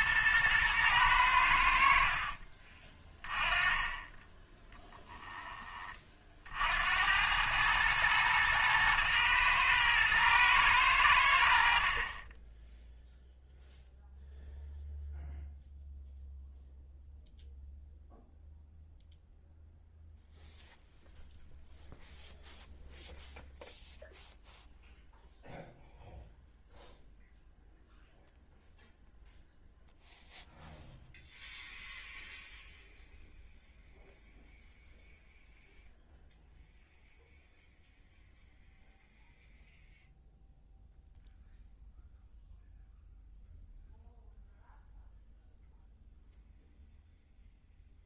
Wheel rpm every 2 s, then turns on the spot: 110, 20, 10, 70, 110, 100, 10, 0, 0, 0, 0, 0, 0, 0, 0, 0, 0, 0, 0, 0, 0, 0, 0, 0.
none